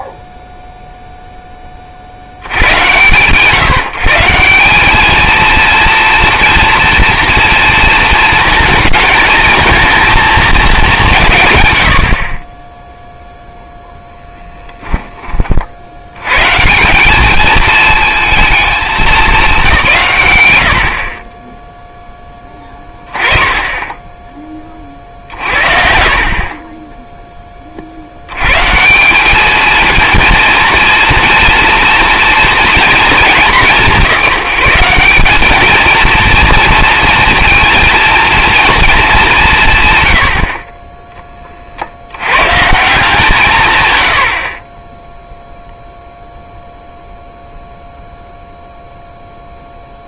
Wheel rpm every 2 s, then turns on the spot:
0, 60, 200, 230, 230, 170, 0, 10, 180, 210, 90, 10, 20, 30, 140, 230, 230, 180, 220, 230, 30, 120, 50, 0, 0.
none